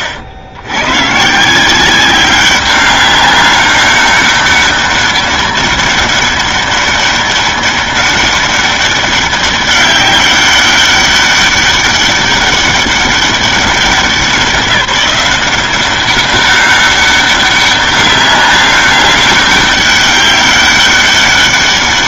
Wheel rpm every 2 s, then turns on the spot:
100, 190, 200, 200, 200, 200, 200, 190, 200, 200, 200.
none